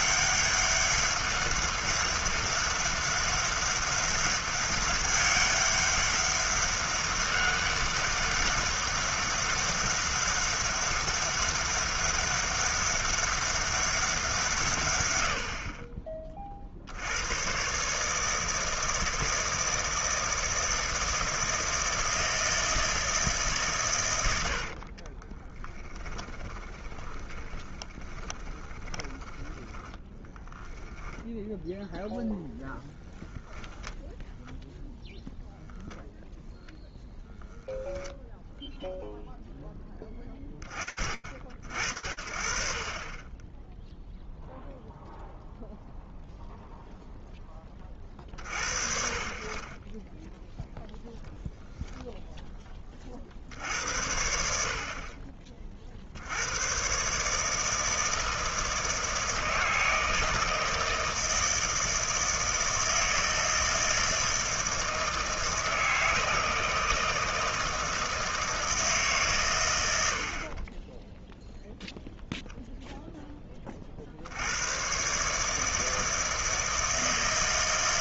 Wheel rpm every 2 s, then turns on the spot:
200, 200, 200, 200, 200, 200, 200, 170, 40, 160, 160, 160, 90, 10, 20, 20, 0, 0, 0, 0, 30, 60, 0, 0, 50, 10, 20, 50, 120, 160, 160, 160, 160, 160, 150, 20, 0, 120, 160.
26-32